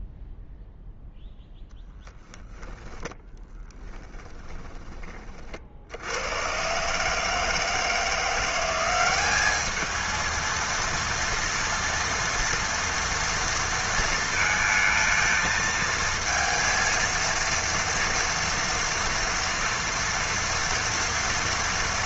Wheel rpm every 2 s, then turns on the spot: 0, 10, 20, 110, 180, 230, 230, 230, 230, 230, 230.
2-6